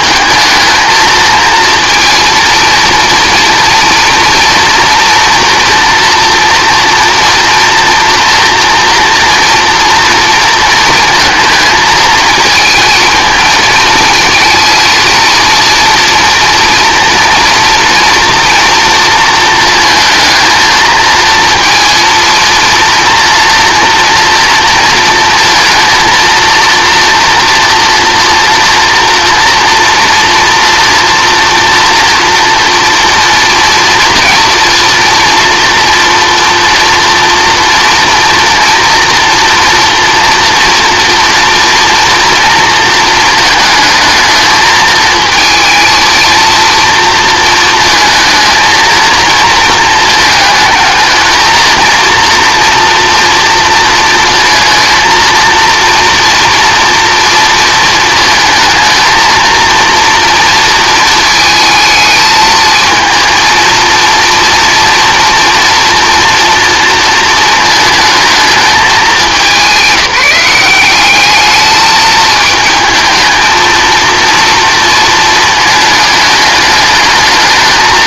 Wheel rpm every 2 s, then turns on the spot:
230, 240, 240, 240, 240, 220, 230, 230, 230, 230, 230, 230, 230, 230, 230, 240, 230, 230, 230, 230, 230, 230, 220, 230, 230, 220, 230, 230, 240, 230, 230, 220, 230, 230, 200, 190, 220, 230, 210.
none